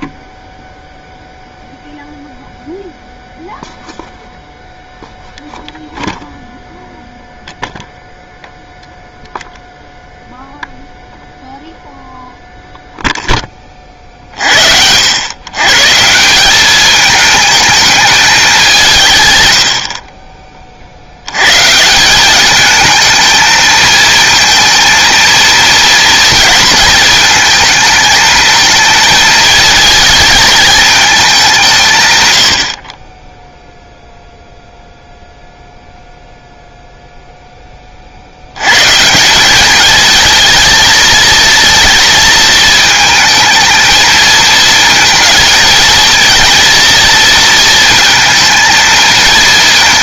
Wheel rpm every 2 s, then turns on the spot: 0, 0, 0, 0, 0, 0, 0, 70, 200, 190, 40, 210, 230, 230, 220, 220, 70, 0, 0, 110, 230, 230, 230, 230, 230.
none